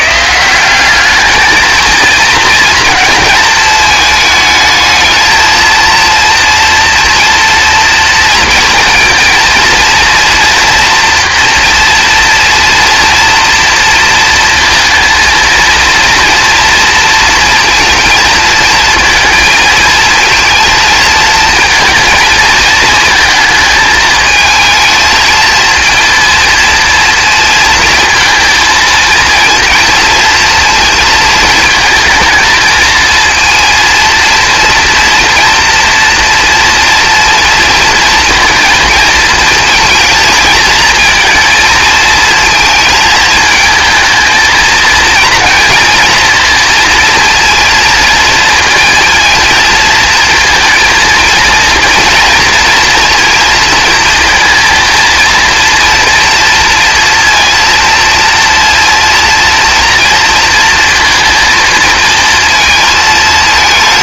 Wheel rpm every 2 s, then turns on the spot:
190, 230, 220, 230, 230, 240, 240, 230, 230, 230, 230, 230, 220, 230, 230, 230, 230, 230, 230, 230, 220, 220, 220, 230, 230, 230, 230, 230, 230, 230, 230, 220.
none